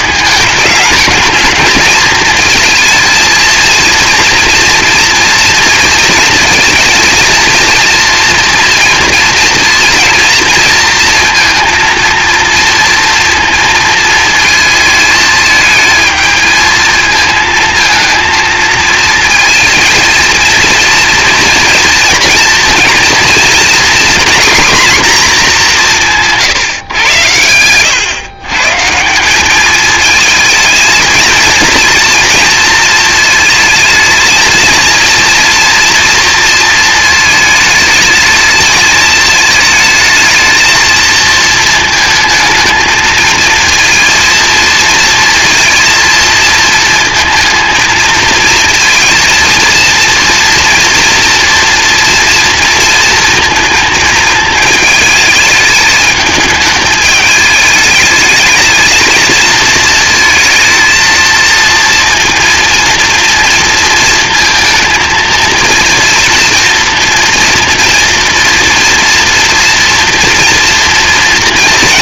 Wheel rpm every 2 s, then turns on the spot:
210, 230, 240, 230, 230, 230, 230, 220, 220, 230, 230, 230, 250, 120, 160, 230, 230, 230, 230, 220, 230, 230, 230, 220, 230, 240, 230, 220, 210, 220, 230, 230, 230, 240, 240, 230.
none